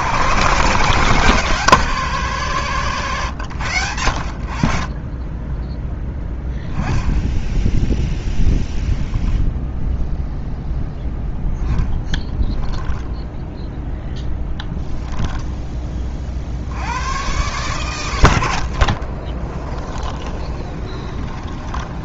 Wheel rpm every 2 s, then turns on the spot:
140, 120, 40, 10, 0, 0, 10, 10, 90, 60, 30.
12-14 18-22